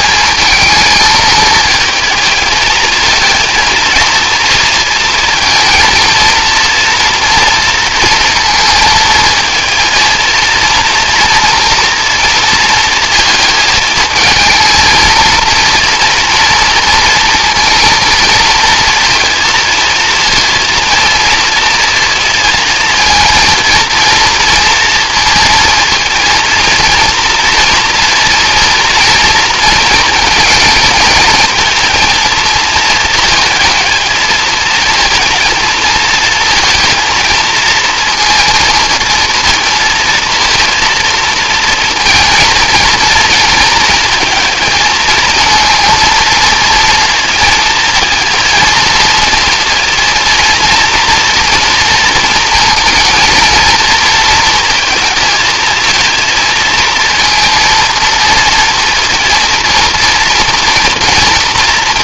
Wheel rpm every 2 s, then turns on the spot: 220, 220, 230, 230, 220, 230, 230, 230, 230, 230, 220, 230, 230, 230, 230, 230, 220, 230, 230, 230, 230, 220, 220, 230, 230, 240, 230, 230, 230, 230, 230.
none